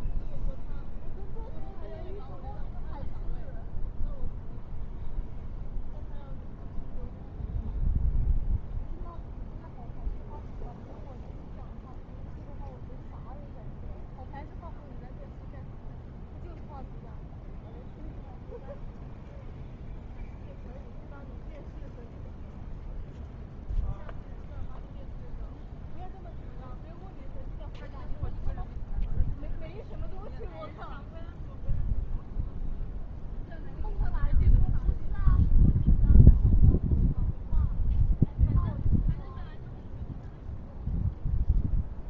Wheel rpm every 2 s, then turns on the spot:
0, 0, 0, 0, 0, 0, 0, 0, 0, 0, 0, 0, 0, 0, 0, 0, 0, 0, 0, 0, 0.
none